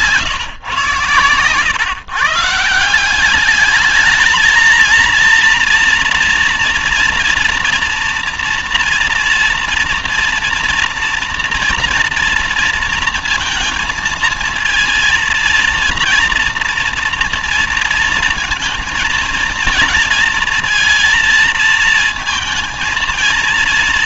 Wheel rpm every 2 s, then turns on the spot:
130, 160, 230, 230, 240, 230, 230, 230, 230, 230, 230, 230.
none